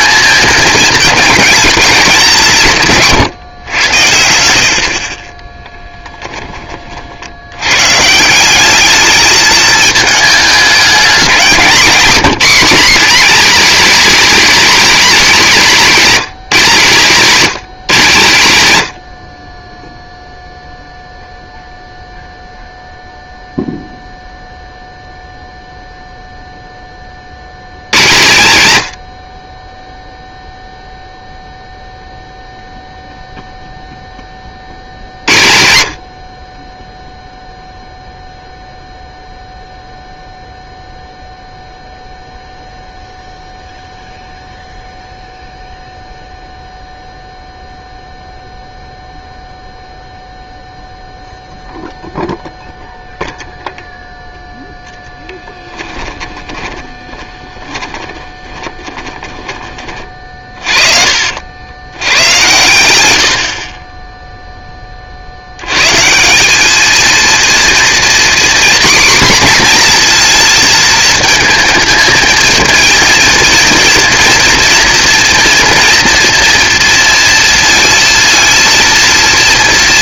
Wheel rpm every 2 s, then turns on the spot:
220, 150, 80, 30, 200, 210, 240, 250, 180, 110, 0, 0, 0, 10, 100, 0, 0, 40, 20, 0, 0, 0, 0, 0, 0, 0, 0, 0, 10, 20, 40, 110, 20, 210, 250, 230, 220, 240, 240, 230.
2-4 56-64